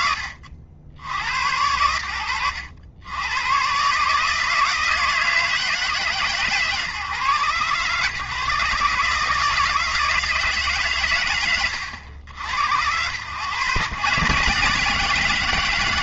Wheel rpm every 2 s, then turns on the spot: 40, 80, 160, 130, 140, 130, 110, 160.
none